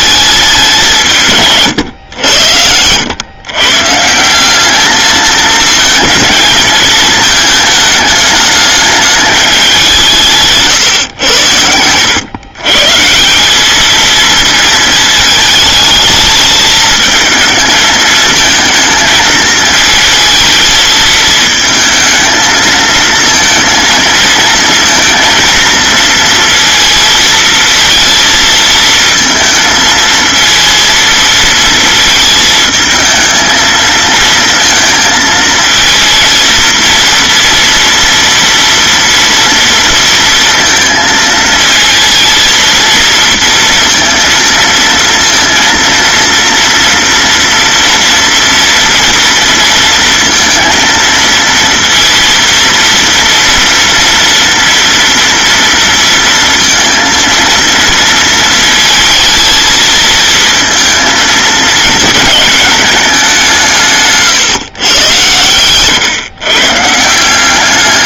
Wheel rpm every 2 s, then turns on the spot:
180, 90, 210, 220, 210, 140, 140, 220, 220, 220, 220, 230, 230, 230, 220, 230, 220, 220, 230, 230, 230, 230, 230, 230, 230, 230, 230, 230, 230, 220, 230, 210, 120, 150.
none